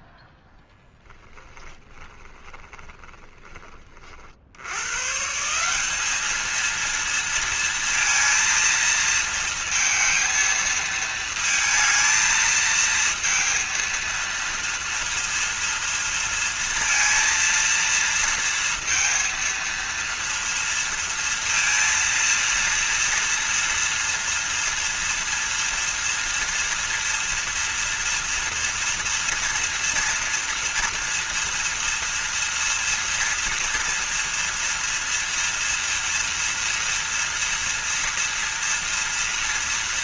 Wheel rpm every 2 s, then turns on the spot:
10, 20, 100, 230, 230, 220, 220, 230, 230, 230, 230, 230, 230, 230, 230, 230, 230, 230, 230, 230.
0-4